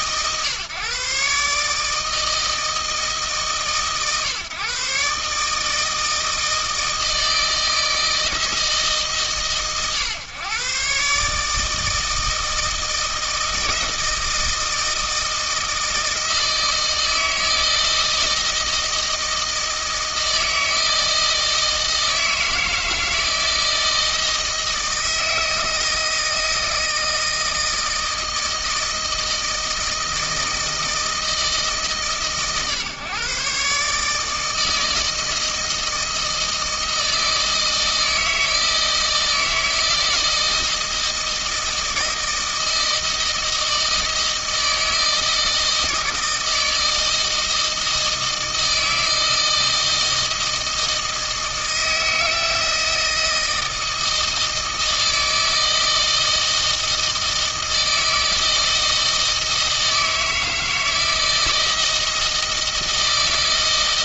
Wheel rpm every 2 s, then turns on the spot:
130, 160, 130, 160, 160, 140, 160, 160, 160, 160, 160, 160, 160, 160, 160, 160, 130, 160, 160, 160, 160, 160, 160, 160, 160, 160, 160, 160, 160, 160, 160, 160.
none